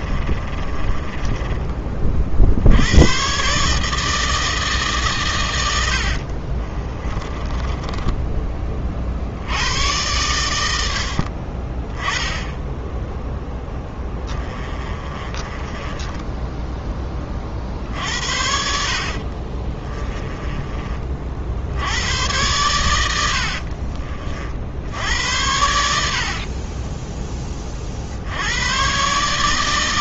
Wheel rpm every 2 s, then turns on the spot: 20, 100, 140, 20, 40, 70, 0, 30, 10, 60, 40, 100, 70, 20, 130.
0-2 6-8 14-16 18-20 26-28